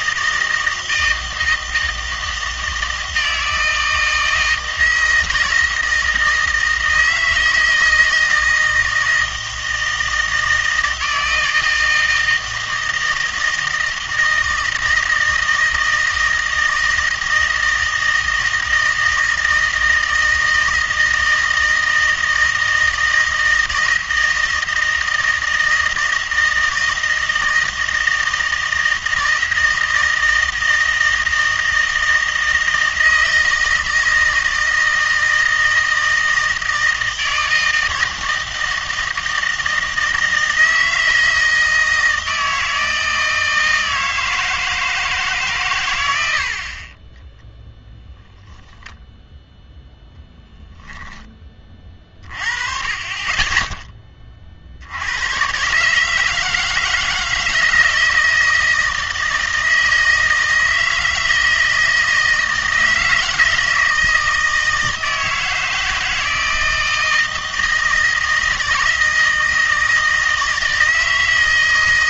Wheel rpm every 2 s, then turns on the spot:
160, 160, 160, 160, 160, 160, 160, 160, 160, 160, 160, 160, 160, 160, 160, 160, 160, 160, 160, 160, 160, 160, 150, 10, 0, 10, 20, 120, 160, 160, 160, 160, 160, 160, 160, 160.
46-48